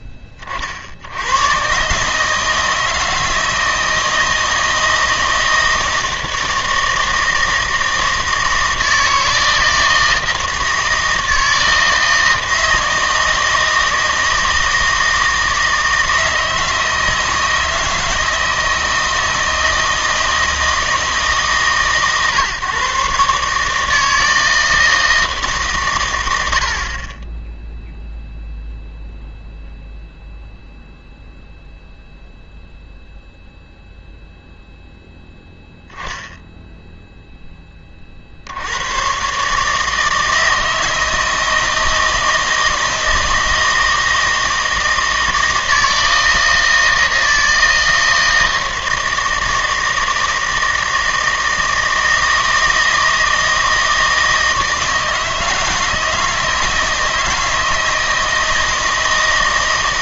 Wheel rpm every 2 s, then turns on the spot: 30, 160, 160, 160, 160, 160, 160, 160, 160, 160, 160, 140, 160, 70, 0, 0, 0, 0, 0, 70, 160, 160, 160, 160, 160, 160, 160, 160, 160, 160.
none